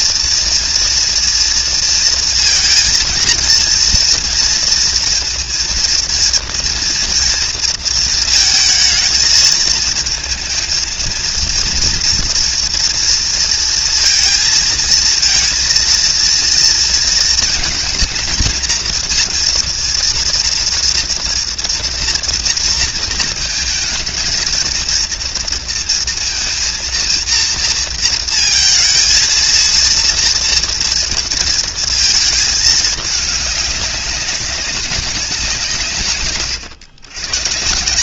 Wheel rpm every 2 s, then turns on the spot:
230, 230, 240, 230, 230, 230, 230, 230, 230, 220, 230, 230, 230, 230, 230, 230, 220, 200, 110.
none